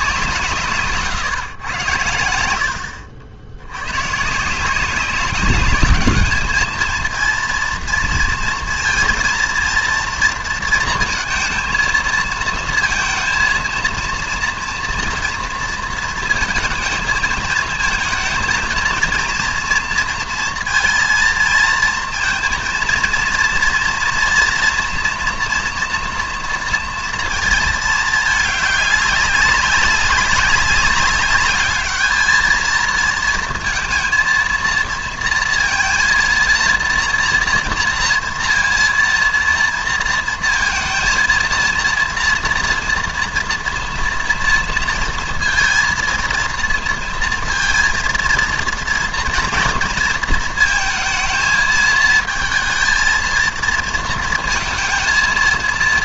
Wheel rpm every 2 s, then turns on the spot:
150, 80, 170, 220, 230, 230, 230, 230, 230, 230, 230, 230, 230, 230, 210, 190, 220, 230, 230, 230, 230, 230, 240, 230, 230, 230, 220, 230.
none